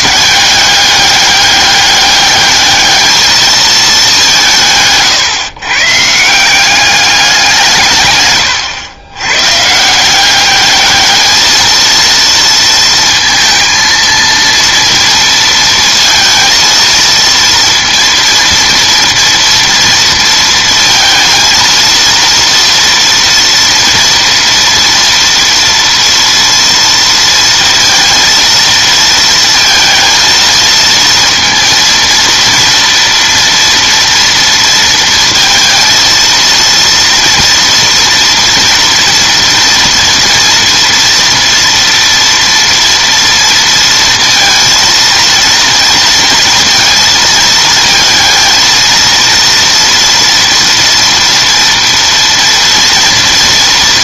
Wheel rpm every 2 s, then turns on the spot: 200, 210, 160, 190, 120, 200, 230, 230, 230, 230, 230, 230, 230, 230, 230, 230, 230, 230, 230, 230, 230, 230, 230, 230, 230, 230, 240.
8-10